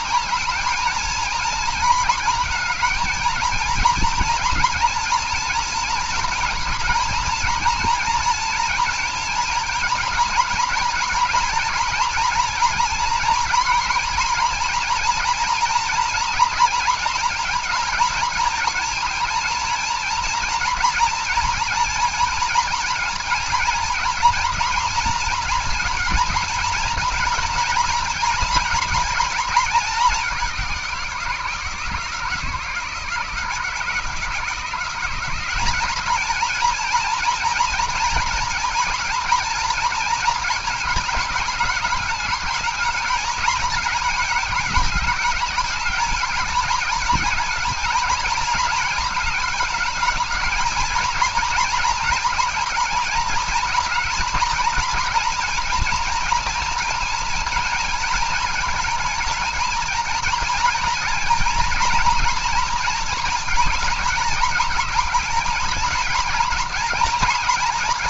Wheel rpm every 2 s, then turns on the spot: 230, 230, 230, 230, 230, 230, 230, 230, 230, 230, 230, 230, 230, 230, 240, 190, 160, 170, 220, 230, 220, 220, 210, 220, 220, 220, 230, 220, 230, 220, 230, 230, 220, 220.
none